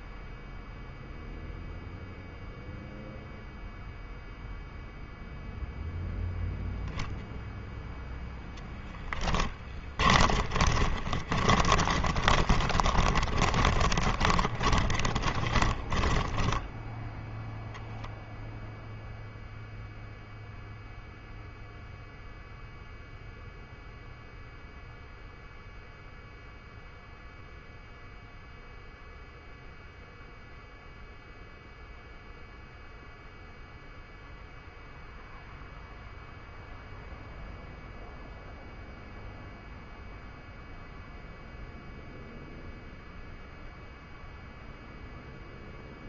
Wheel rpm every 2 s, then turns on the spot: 0, 0, 0, 0, 10, 30, 40, 30, 0, 0, 0, 0, 0, 0, 0, 0, 0, 0, 0, 0, 0, 0, 0.
8-16